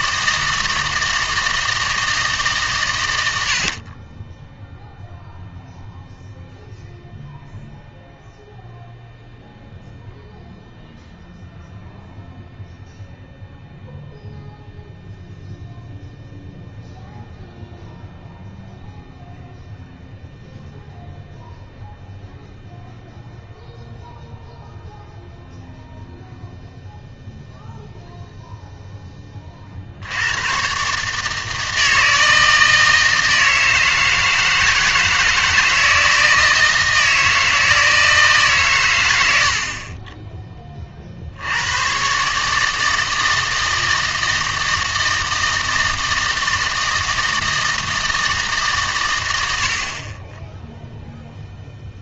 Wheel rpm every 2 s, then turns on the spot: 160, 140, 0, 0, 0, 0, 0, 0, 0, 0, 0, 0, 0, 0, 0, 120, 160, 160, 160, 130, 20, 150, 160, 160, 140, 0.
none